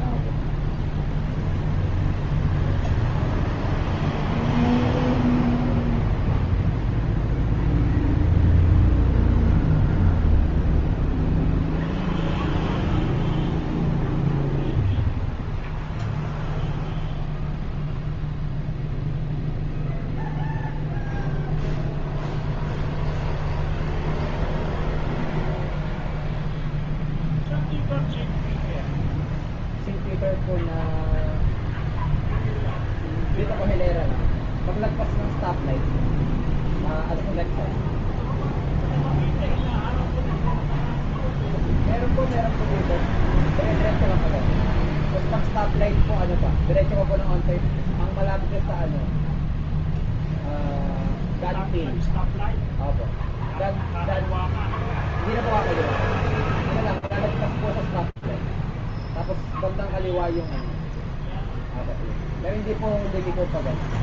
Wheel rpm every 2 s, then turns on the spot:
0, 0, 0, 0, 0, 0, 0, 0, 0, 0, 0, 0, 0, 0, 0, 0, 0, 0, 0, 0, 0, 0, 0, 0, 0, 0, 0, 0, 0, 0, 0, 0.
none